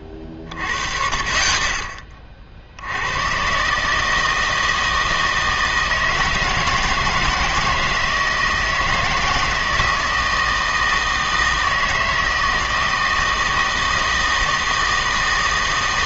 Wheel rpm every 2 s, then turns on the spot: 30, 60, 160, 160, 160, 160, 160, 160.
none